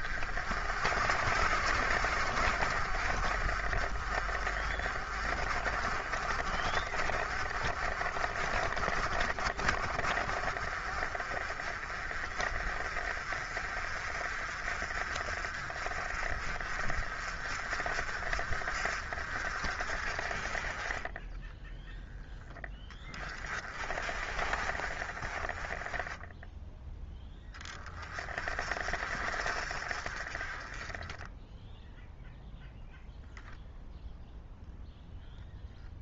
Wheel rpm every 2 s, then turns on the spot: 50, 50, 40, 30, 40, 40, 40, 40, 40, 50, 30, 10, 40, 10, 40, 20, 0, 0.
none